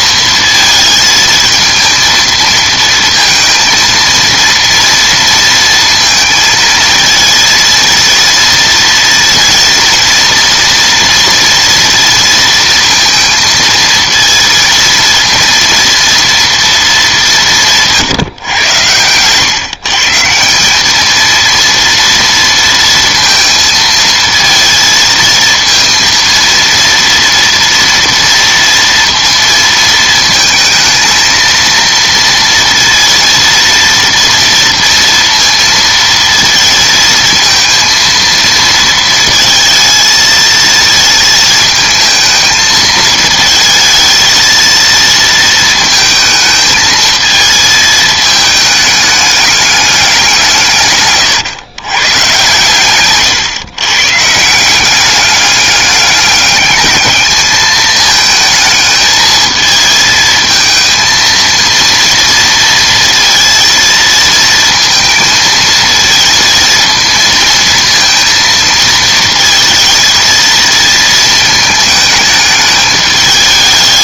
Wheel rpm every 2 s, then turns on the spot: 220, 230, 230, 230, 230, 230, 230, 230, 210, 110, 210, 230, 230, 230, 230, 230, 230, 230, 230, 230, 230, 220, 230, 220, 210, 150, 130, 190, 210, 220, 220, 230, 220, 230, 230, 230, 210.
none